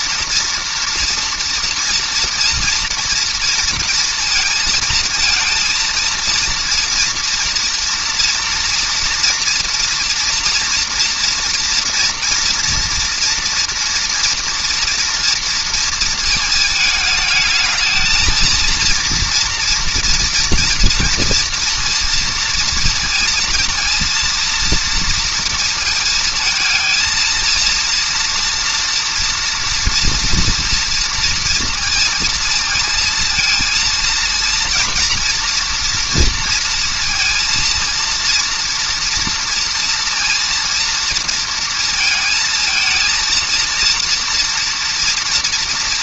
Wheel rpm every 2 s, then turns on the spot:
230, 230, 220, 230, 230, 230, 230, 230, 220, 240, 230, 230, 230, 230, 230, 230, 230, 230, 230, 230, 230, 230, 230.
none